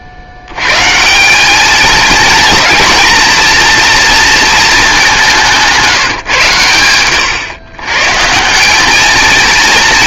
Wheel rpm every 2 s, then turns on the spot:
110, 220, 220, 130, 190.
none